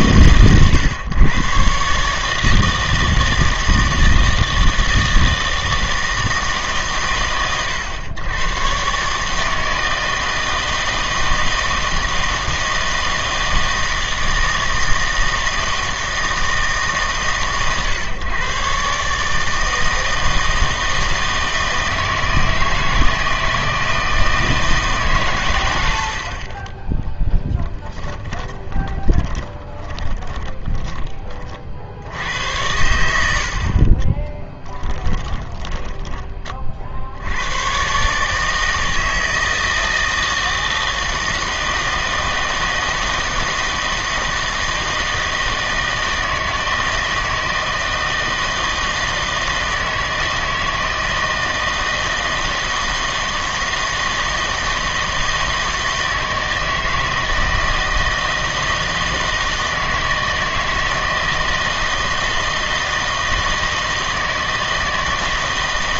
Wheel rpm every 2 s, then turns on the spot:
120, 160, 160, 150, 130, 160, 160, 160, 150, 130, 160, 160, 160, 20, 20, 20, 80, 10, 40, 160, 160, 160, 160, 160, 160, 160, 160, 160, 160, 160, 160, 160, 160.
28-32 34-36